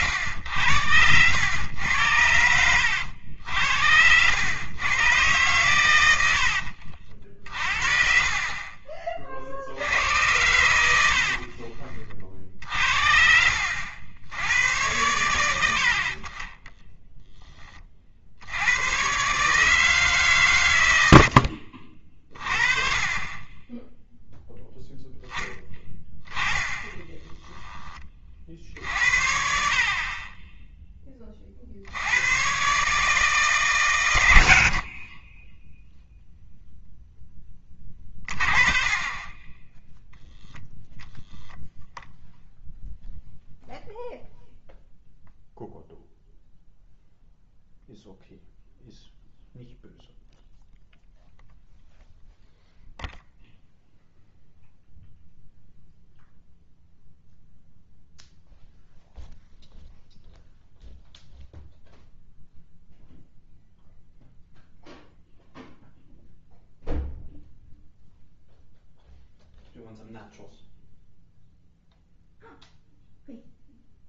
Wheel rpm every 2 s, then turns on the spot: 90, 80, 110, 80, 40, 90, 50, 90, 20, 90, 130, 40, 0, 10, 60, 10, 120, 70, 0, 30, 10, 0, 0, 0, 0, 0, 0, 0, 0, 0, 0, 0, 0, 0, 0, 0, 0.
2-4 6-8 16-18